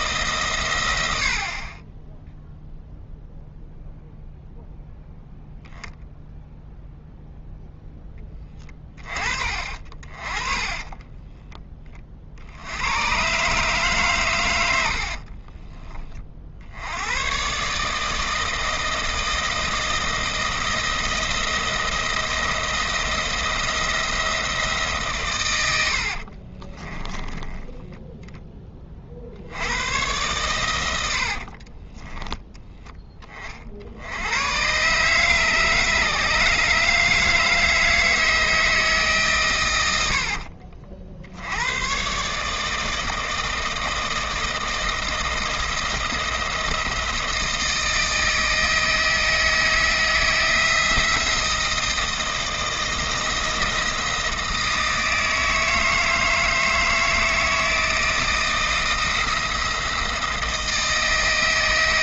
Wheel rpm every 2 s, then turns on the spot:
110, 0, 0, 0, 30, 30, 100, 90, 90, 160, 170, 170, 150, 30, 30, 110, 10, 120, 150, 160, 50, 160, 160, 160, 160, 170, 170, 170, 160, 170, 160.
10-12 26-28